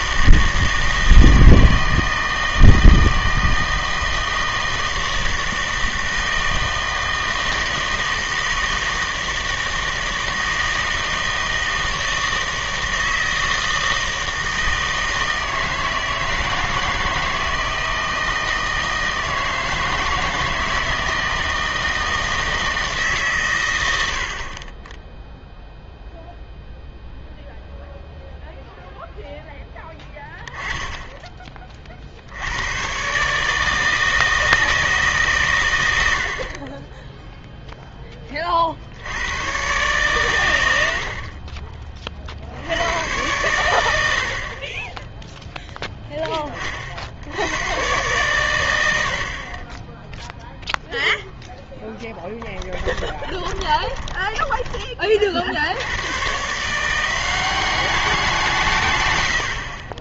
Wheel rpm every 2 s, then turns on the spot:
160, 160, 160, 160, 160, 160, 160, 160, 160, 160, 160, 160, 30, 0, 0, 10, 100, 160, 30, 40, 90, 80, 40, 40, 90, 0, 10, 20, 160, 150.
52-54